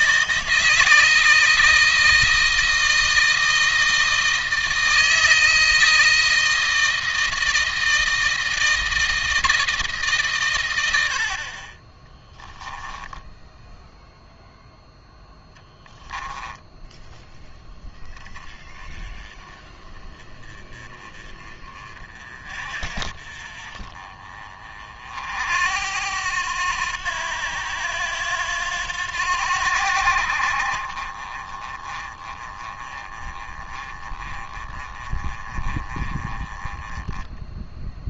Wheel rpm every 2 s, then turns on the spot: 160, 160, 160, 160, 160, 100, 10, 0, 10, 20, 30, 40, 40, 90, 90, 40, 20, 20, 20.
none